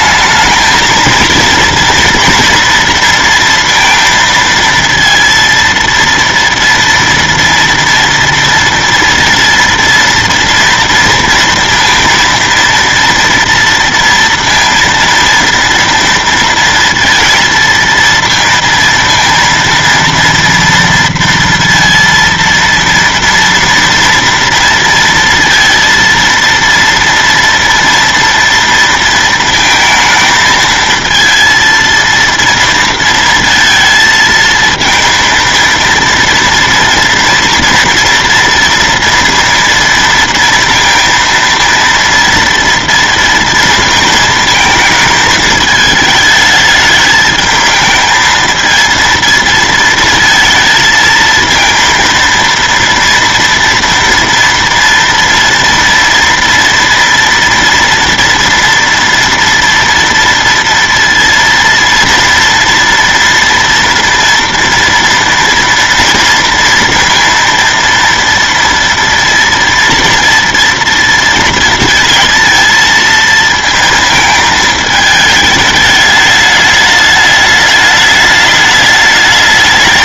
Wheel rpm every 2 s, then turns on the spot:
220, 230, 230, 230, 230, 230, 230, 230, 230, 230, 230, 230, 230, 230, 240, 220, 230, 220, 230, 230, 230, 230, 220, 220, 220, 220, 230, 230, 230, 230, 230, 230, 230, 230, 230, 230, 230, 220, 210, 210.
none